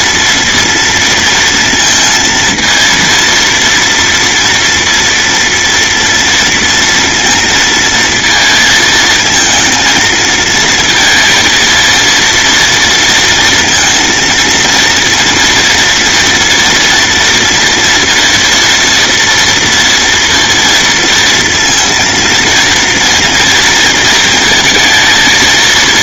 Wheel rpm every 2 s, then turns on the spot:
230, 230, 240, 230, 220, 230, 230, 230, 230, 230, 230, 230, 230.
none